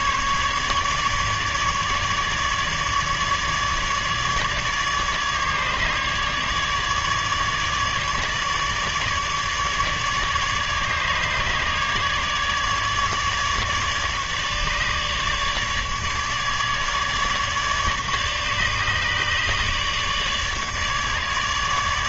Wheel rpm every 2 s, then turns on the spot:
150, 150, 150, 150, 150, 150, 150, 150, 150, 150, 150.
none